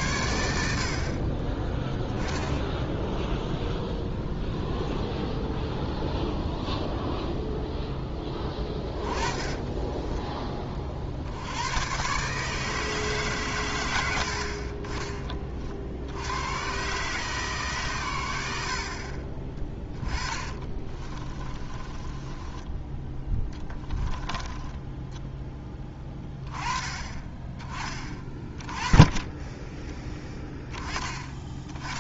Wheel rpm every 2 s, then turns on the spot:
50, 0, 0, 0, 20, 40, 150, 50, 130, 60, 30, 20, 10, 20, 20, 20.
8-10 20-26